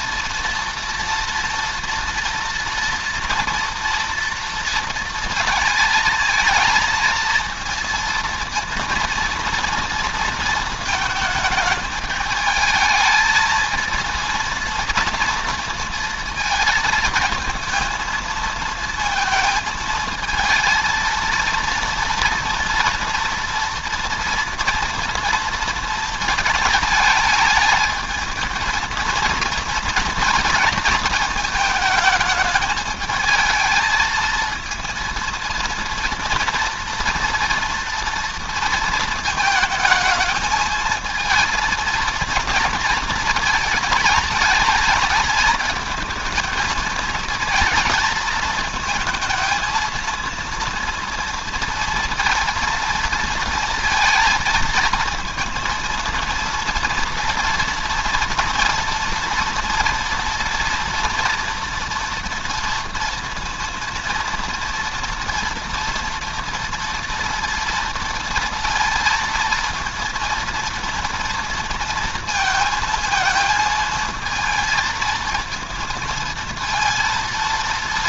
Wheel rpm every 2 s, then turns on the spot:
230, 230, 230, 230, 230, 230, 220, 230, 230, 230, 230, 230, 240, 220, 220, 230, 220, 230, 230, 230, 220, 230, 210, 220, 220, 230, 230, 230, 230, 240, 240, 230, 230, 230, 230, 230, 230, 230, 230.
none